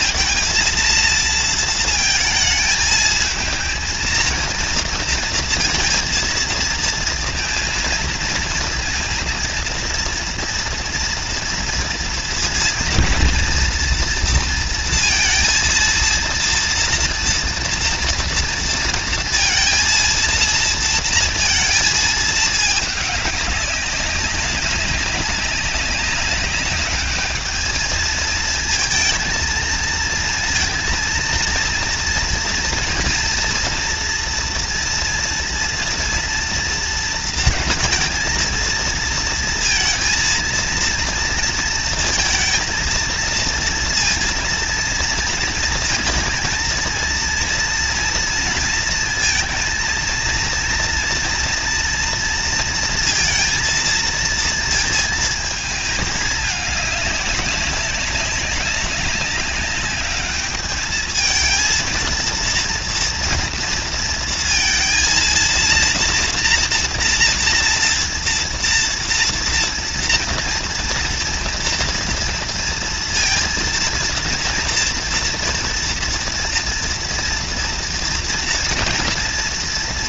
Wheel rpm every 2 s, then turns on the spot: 230, 220, 230, 230, 230, 230, 230, 230, 230, 240, 230, 220, 200, 200, 220, 230, 230, 230, 230, 220, 230, 230, 230, 230, 230, 230, 230, 230, 210, 200, 210, 230, 230, 230, 230, 230, 230, 230, 230, 230.
none